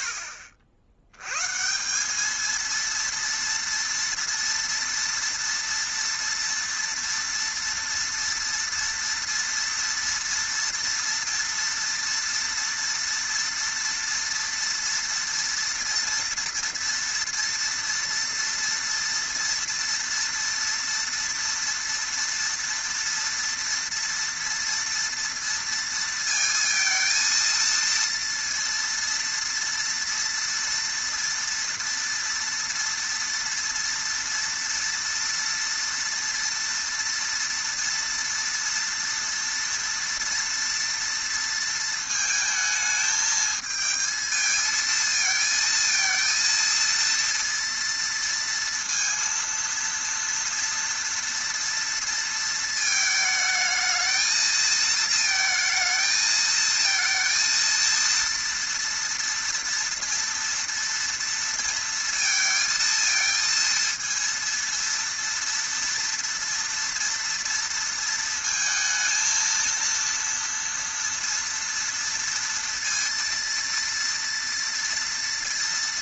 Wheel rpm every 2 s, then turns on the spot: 80, 230, 230, 230, 230, 230, 230, 240, 230, 240, 230, 230, 230, 230, 230, 230, 230, 230, 230, 230, 230, 220, 230, 230, 230, 230, 220, 220, 230, 230, 230, 230, 230, 230, 230, 230, 230, 230.
none